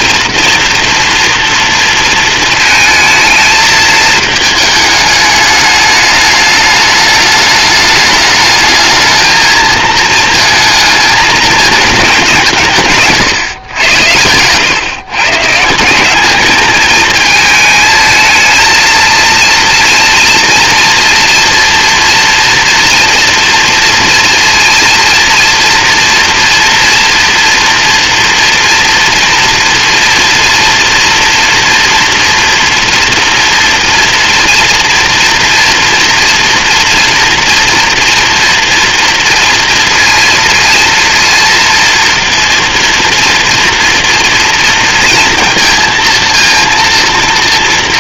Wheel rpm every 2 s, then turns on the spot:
230, 220, 210, 210, 210, 220, 160, 120, 210, 220, 230, 240, 230, 230, 240, 230, 230, 240, 230, 230, 230, 230, 230, 230.
none